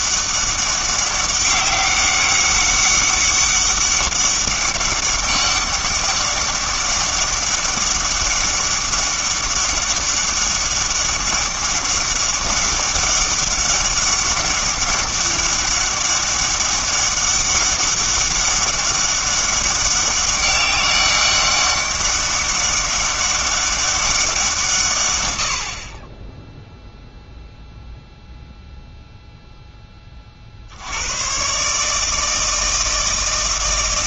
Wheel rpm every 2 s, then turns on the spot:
200, 200, 200, 200, 200, 200, 200, 200, 200, 200, 200, 200, 150, 0, 0, 80, 160.
none